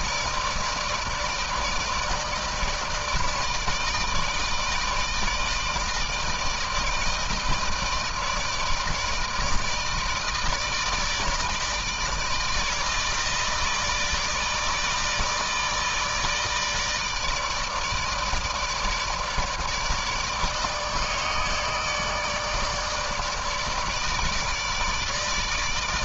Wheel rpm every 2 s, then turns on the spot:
160, 160, 160, 160, 160, 160, 160, 160, 160, 160, 150, 150, 160.
none